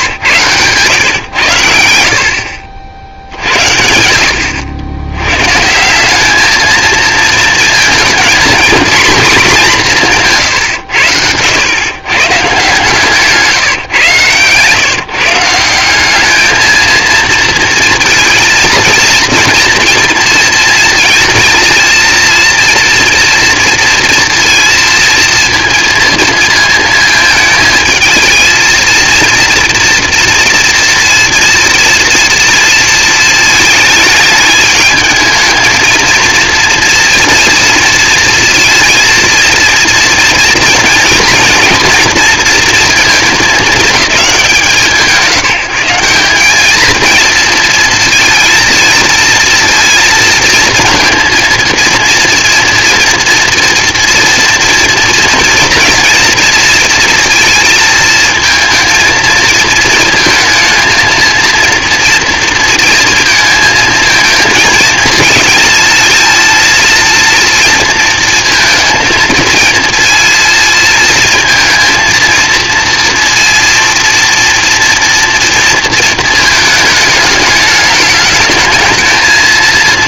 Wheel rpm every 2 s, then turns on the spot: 120, 60, 90, 220, 230, 120, 150, 130, 220, 230, 230, 230, 230, 220, 230, 230, 230, 220, 230, 230, 230, 230, 170, 210, 230, 230, 230, 230, 230, 230, 230, 230, 220, 220, 220, 230, 230, 230, 220, 220.
0-2